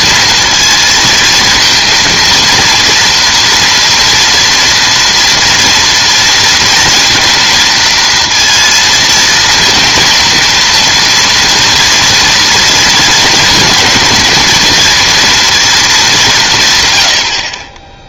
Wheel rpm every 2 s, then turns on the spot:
230, 230, 230, 230, 230, 230, 230, 230, 140.
none